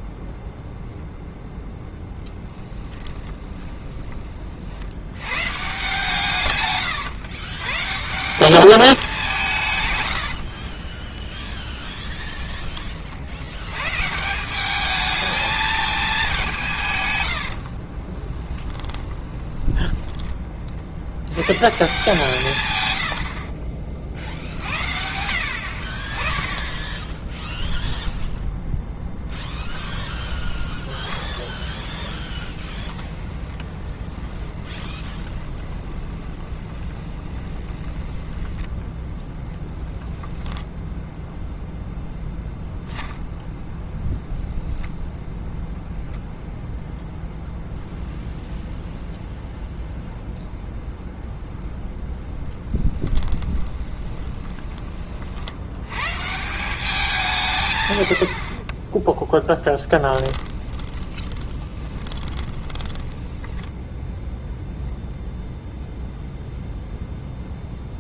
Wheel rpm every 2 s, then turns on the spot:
0, 20, 60, 130, 200, 30, 50, 210, 150, 20, 50, 110, 70, 10, 0, 0, 20, 10, 20, 10, 10, 0, 0, 0, 0, 0, 10, 20, 180, 20, 20, 10, 0, 0.
2-4 10-12 18-20 22-24 32-38 52-54 58-64